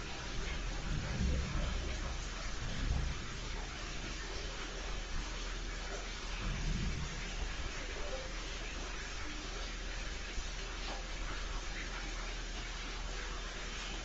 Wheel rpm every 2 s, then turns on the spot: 0, 0, 0, 0, 0, 0, 0.
none